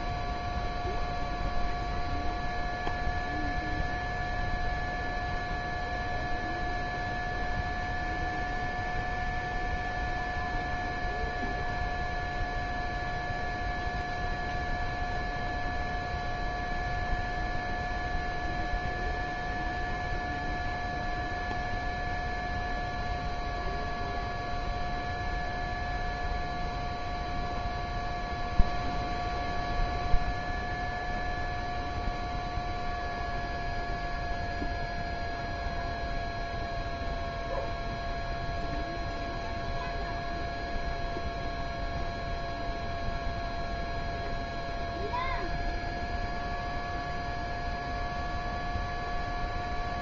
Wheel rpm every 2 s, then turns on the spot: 0, 0, 0, 0, 0, 0, 0, 0, 0, 0, 0, 0, 0, 0, 0, 0, 0, 0, 0, 0, 0, 0, 0, 0, 0.
none